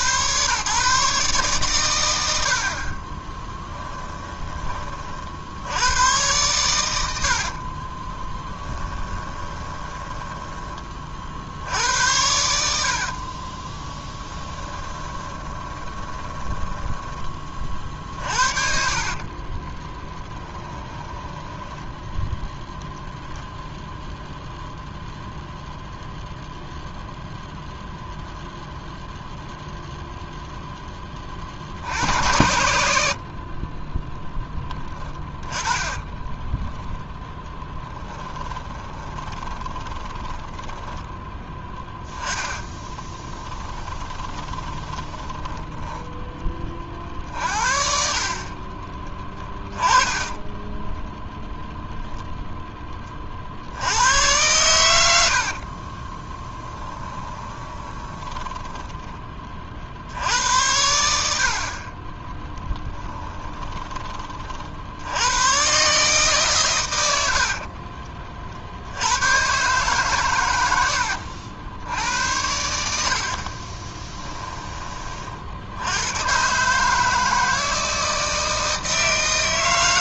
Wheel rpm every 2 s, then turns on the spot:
140, 50, 30, 100, 10, 20, 70, 10, 10, 50, 10, 0, 0, 0, 0, 10, 80, 20, 10, 20, 10, 10, 20, 30, 30, 10, 20, 100, 10, 20, 90, 10, 60, 120, 70, 90, 70, 20, 150, 160.
8-10 12-22 34-40 42-46 56-60 62-64 70-72